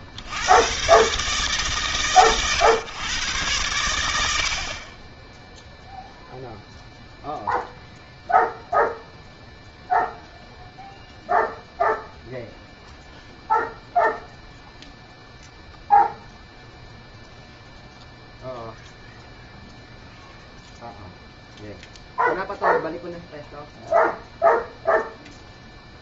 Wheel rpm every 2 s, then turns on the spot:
70, 120, 120, 0, 0, 0, 0, 0, 0, 0, 0, 0, 0.
none